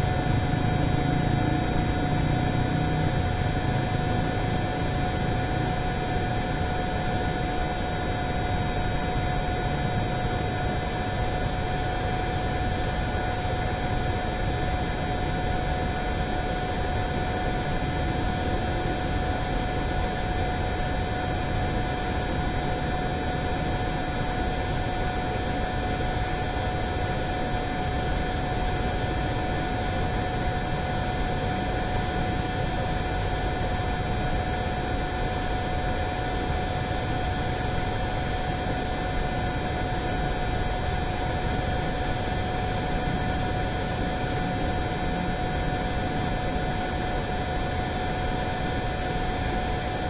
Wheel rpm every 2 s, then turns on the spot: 0, 0, 0, 0, 0, 0, 0, 0, 0, 0, 0, 0, 0, 0, 0, 0, 0, 0, 0, 0, 0, 0, 0, 0, 0.
none